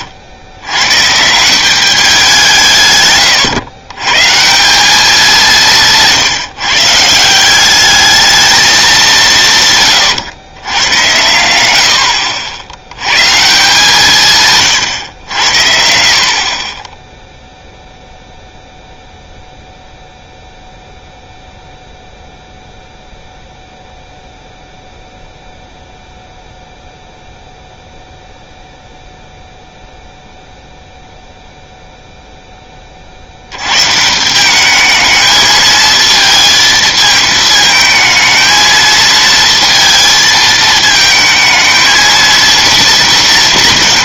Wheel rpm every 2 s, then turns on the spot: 120, 140, 200, 150, 210, 100, 80, 130, 20, 0, 0, 0, 0, 0, 0, 0, 10, 200, 220, 220, 220, 230.
none